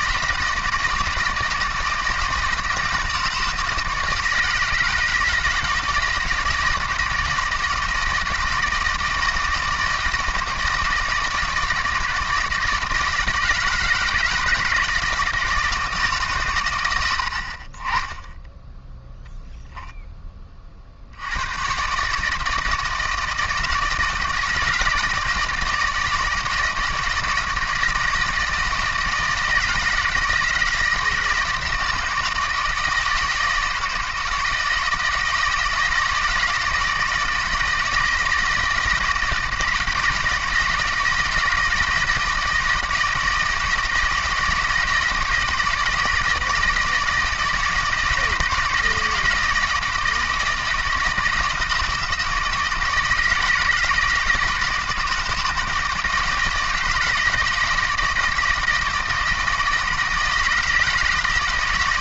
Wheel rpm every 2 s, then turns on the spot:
160, 160, 160, 160, 160, 160, 160, 160, 110, 10, 40, 160, 160, 160, 160, 160, 160, 170, 160, 160, 160, 160, 160, 170, 160, 160, 160, 160, 160, 160, 160.
none